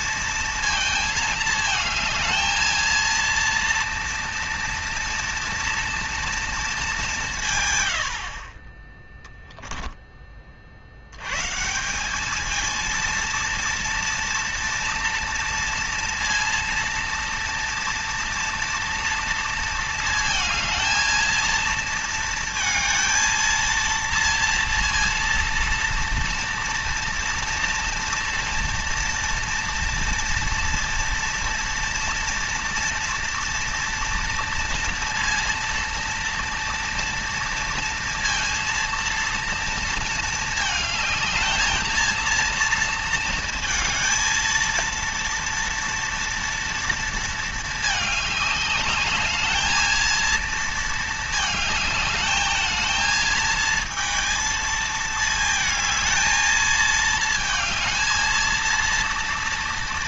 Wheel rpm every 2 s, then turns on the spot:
220, 230, 230, 190, 10, 80, 230, 230, 230, 230, 220, 230, 230, 240, 230, 230, 240, 230, 230, 230, 220, 230, 230, 230, 210, 220, 220, 220, 220, 230.
none